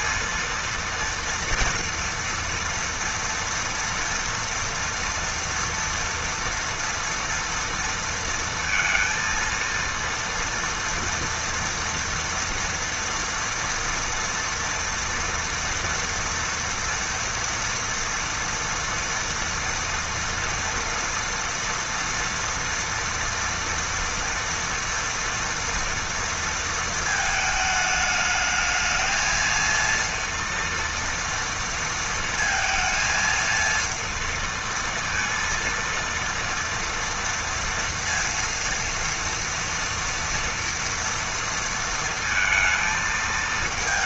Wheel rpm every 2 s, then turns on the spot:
230, 230, 230, 230, 230, 230, 230, 240, 230, 230, 240, 230, 230, 230, 220, 230, 230, 230, 230, 230, 240, 230.
none